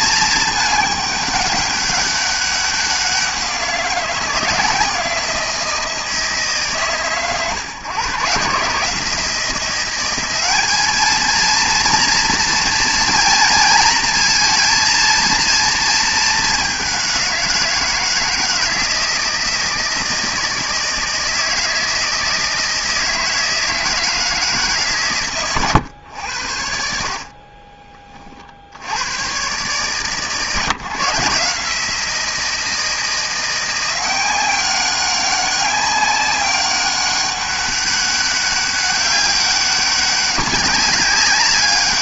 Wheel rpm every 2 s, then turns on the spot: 210, 190, 170, 140, 150, 200, 230, 230, 210, 160, 160, 160, 160, 80, 70, 140, 170, 190, 200, 200, 200.
none